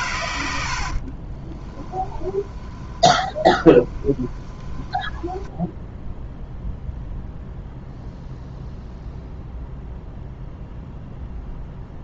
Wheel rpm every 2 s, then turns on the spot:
50, 20, 10, 0, 0, 0.
0-6